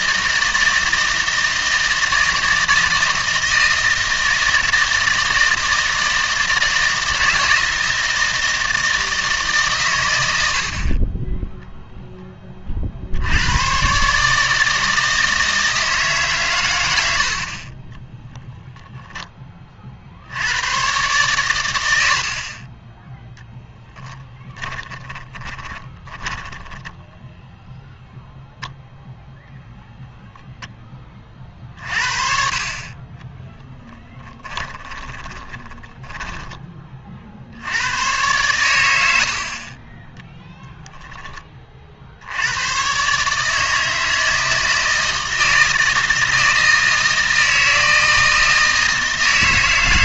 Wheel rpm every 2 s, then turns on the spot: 160, 160, 160, 160, 160, 50, 40, 160, 110, 0, 100, 30, 20, 10, 0, 10, 40, 20, 20, 90, 0, 110, 160, 160, 160.
24-28 34-36